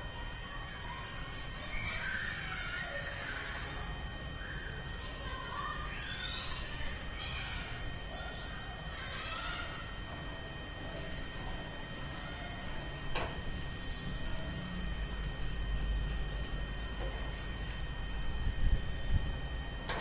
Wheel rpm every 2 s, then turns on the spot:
0, 0, 0, 0, 0, 0, 0, 0, 0, 0.
none